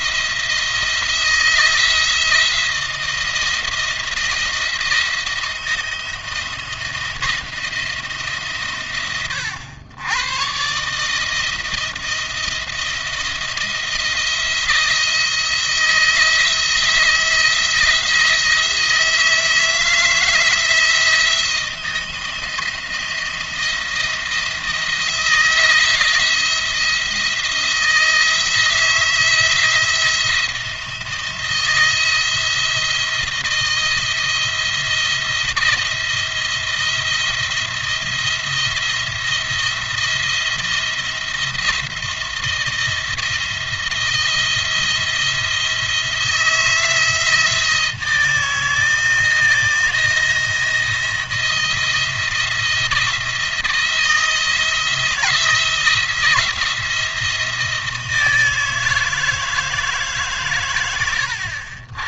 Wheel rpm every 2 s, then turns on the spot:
170, 170, 170, 170, 140, 130, 170, 170, 170, 170, 160, 160, 170, 170, 160, 170, 170, 170, 170, 170, 170, 160, 170, 160, 160, 170, 170, 170, 170, 160, 130.
none